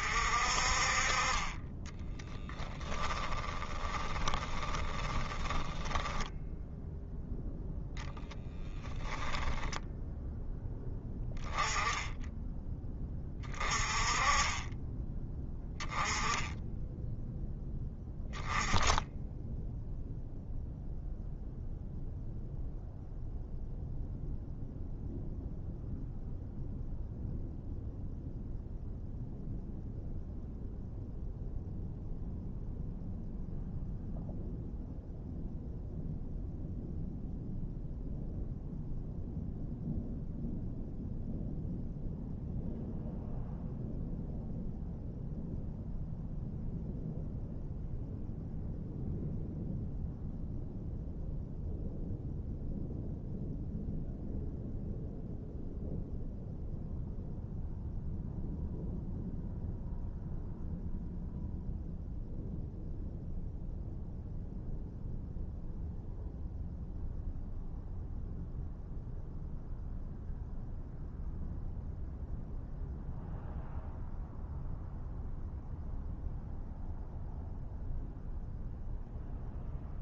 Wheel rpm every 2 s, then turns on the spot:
40, 10, 20, 10, 20, 10, 20, 20, 10, 10, 0, 0, 0, 0, 0, 0, 0, 0, 0, 0, 0, 0, 0, 0, 0, 0, 0, 0, 0, 0, 0, 0, 0, 0, 0, 0, 0, 0, 0, 0.
2-6 8-10